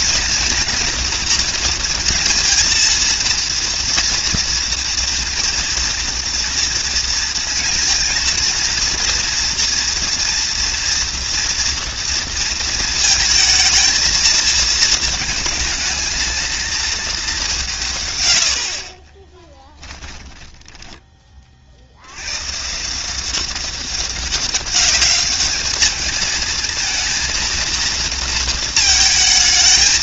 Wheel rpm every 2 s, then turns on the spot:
240, 230, 230, 230, 230, 230, 230, 220, 220, 40, 10, 160, 200, 230, 220.
18-20